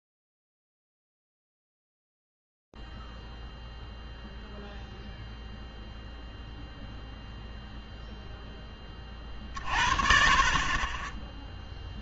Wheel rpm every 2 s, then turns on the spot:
0, 0, 0, 0, 0, 40.
none